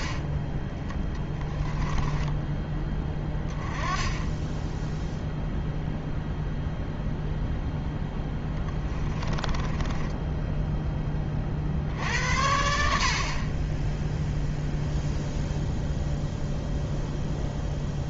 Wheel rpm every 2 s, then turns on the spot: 20, 20, 10, 0, 10, 10, 60, 0, 0.
8-10